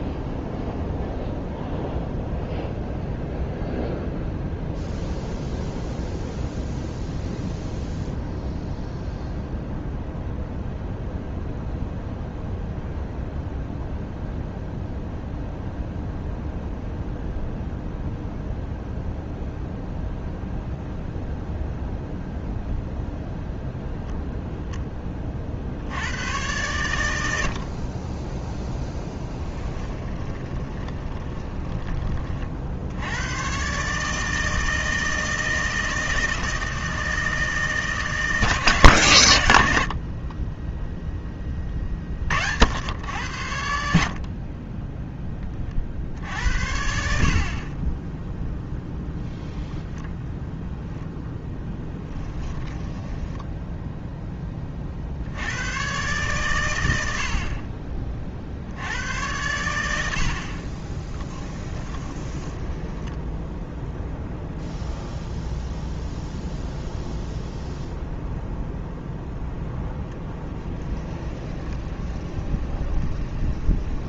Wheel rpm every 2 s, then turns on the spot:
0, 0, 0, 0, 0, 0, 0, 0, 0, 0, 0, 0, 10, 100, 0, 20, 70, 160, 160, 150, 10, 90, 10, 60, 0, 0, 10, 40, 90, 70, 30, 10, 0, 0, 0, 20, 20.
30-32 52-54 60-64 70-74